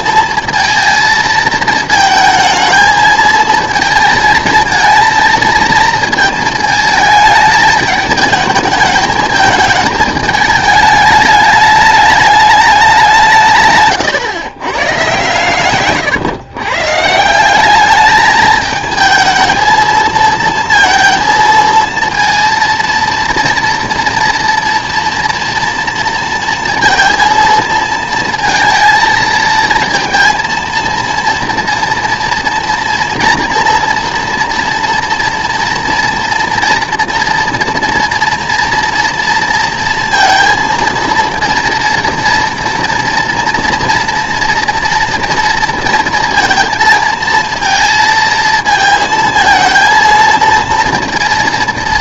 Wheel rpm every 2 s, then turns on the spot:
220, 220, 230, 220, 220, 220, 210, 120, 120, 220, 230, 230, 240, 230, 230, 230, 230, 230, 230, 240, 230, 230, 230, 230, 220, 230.
none